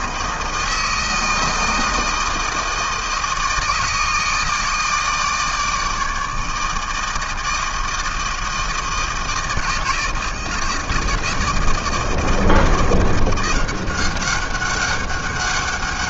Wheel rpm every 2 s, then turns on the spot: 160, 160, 160, 160, 160, 160, 170, 200.
none